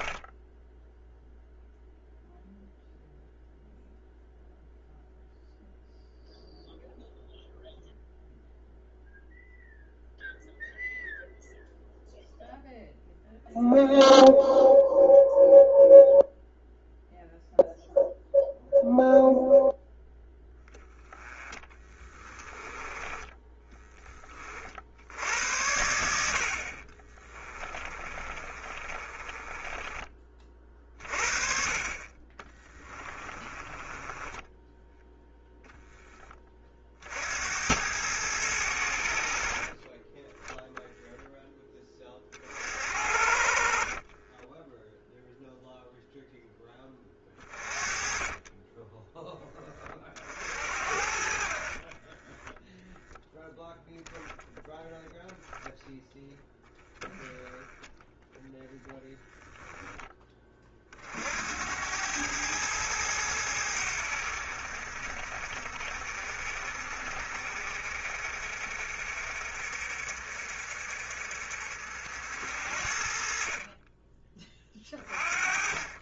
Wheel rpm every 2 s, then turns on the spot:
0, 0, 0, 0, 0, 0, 0, 0, 0, 0, 10, 20, 60, 30, 30, 40, 20, 0, 50, 80, 0, 60, 0, 20, 20, 60, 0, 0, 10, 0, 50, 100, 50, 50, 60, 50, 50, 20.
22-24 26-30 32-34 46-48